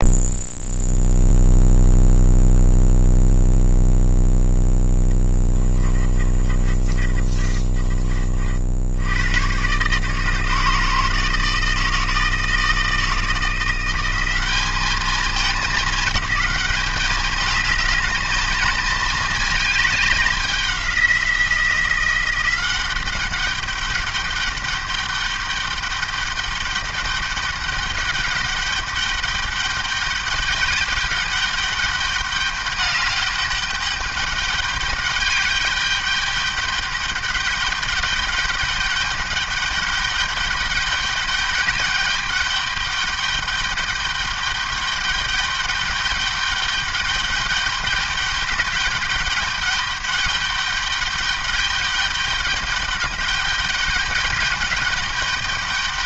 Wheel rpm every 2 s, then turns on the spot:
0, 0, 10, 30, 70, 150, 160, 200, 200, 220, 190, 190, 210, 210, 200, 200, 200, 200, 210, 200, 210, 210, 200, 200, 200, 210, 210, 210.
6-8